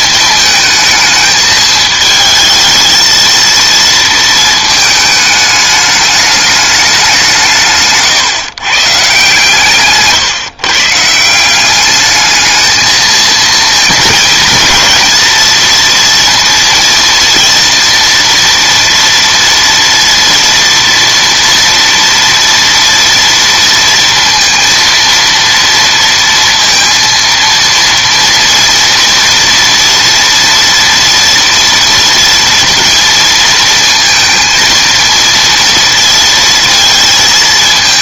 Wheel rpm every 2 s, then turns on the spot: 220, 220, 220, 200, 130, 140, 220, 230, 240, 230, 240, 230, 230, 230, 230, 230, 230, 230, 230.
none